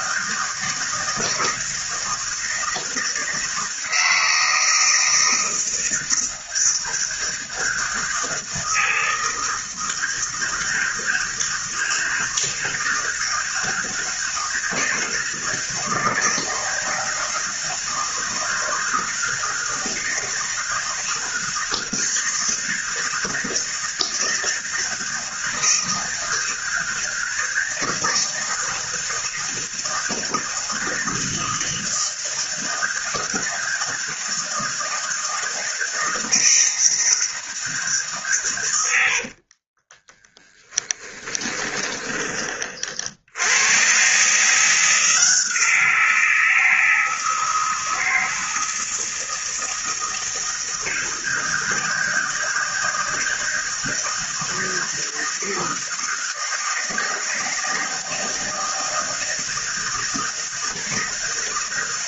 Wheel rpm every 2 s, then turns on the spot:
160, 160, 160, 160, 160, 160, 160, 160, 160, 160, 160, 160, 160, 160, 160, 160, 160, 160, 160, 120, 10, 30, 160, 160, 160, 160, 160, 160, 160, 160, 160.
40-42